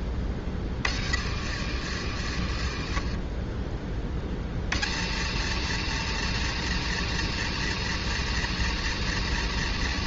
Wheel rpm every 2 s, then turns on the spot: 40, 50, 70, 120, 120.
none